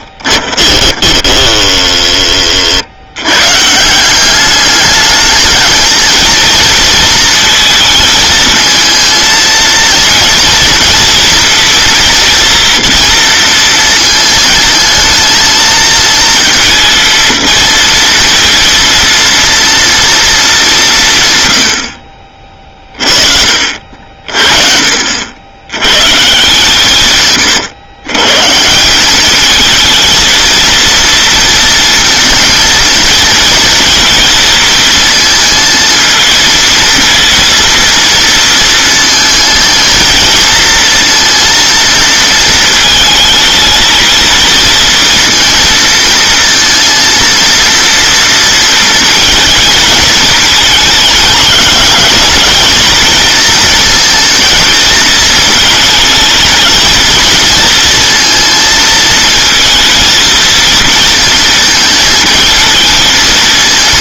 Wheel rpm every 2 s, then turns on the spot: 20, 80, 210, 230, 230, 230, 230, 230, 230, 230, 180, 30, 50, 150, 190, 230, 230, 230, 230, 230, 230, 220, 230, 230, 230, 220, 220, 220, 230, 220, 230, 220.
0-2